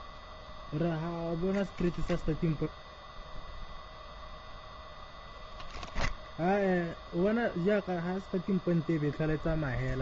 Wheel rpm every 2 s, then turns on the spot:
0, 0, 0, 10, 10.
6-10